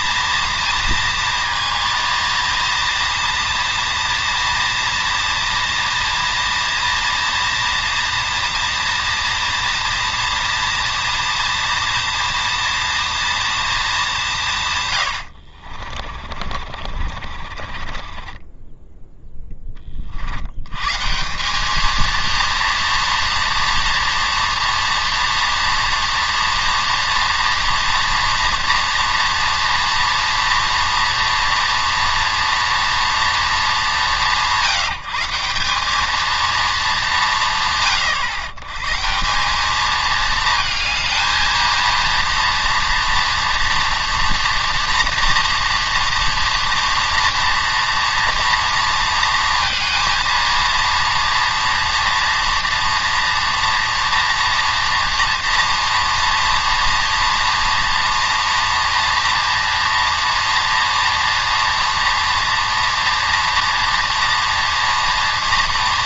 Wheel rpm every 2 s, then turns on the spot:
230, 230, 230, 230, 240, 240, 240, 110, 50, 10, 150, 230, 240, 240, 230, 230, 230, 170, 190, 160, 220, 230, 230, 230, 230, 230, 230, 230, 230, 240, 230, 230, 230.
14-18